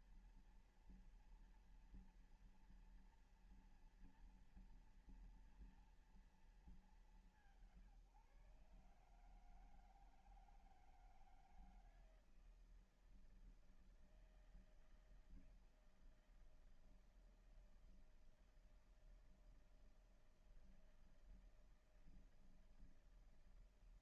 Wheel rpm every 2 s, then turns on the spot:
230, 230, 230, 200, 140, 160, 160, 160, 160, 160, 160, 160.
none